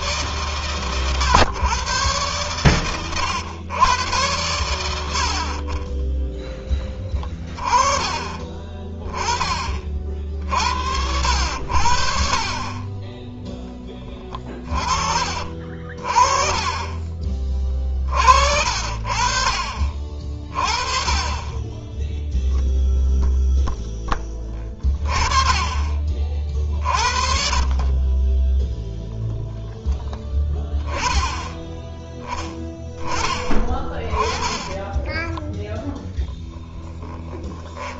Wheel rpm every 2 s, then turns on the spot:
140, 120, 100, 20, 20, 50, 40, 20, 30, 50, 40, 0, 10, 40, 10, 20, 10, 20, 10.
14-16 28-30 34-36